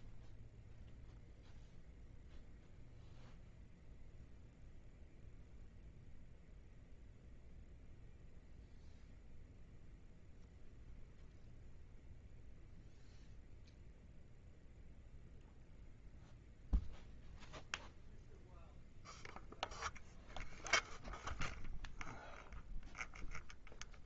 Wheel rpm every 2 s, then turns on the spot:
0, 0, 0, 0, 0, 0, 0, 0, 0, 0, 0, 0.
none